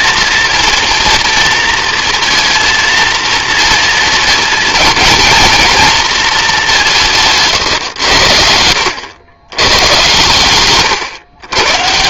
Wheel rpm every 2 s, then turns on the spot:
240, 230, 220, 210, 80, 120.
none